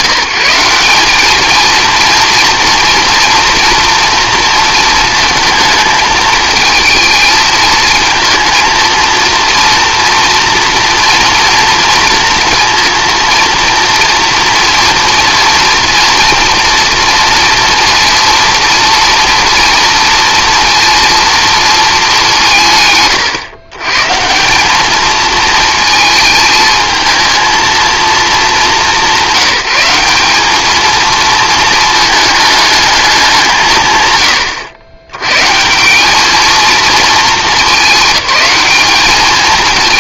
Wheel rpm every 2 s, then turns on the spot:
180, 230, 230, 220, 230, 230, 230, 230, 230, 230, 230, 160, 190, 220, 200, 210, 210, 100, 220, 210.
none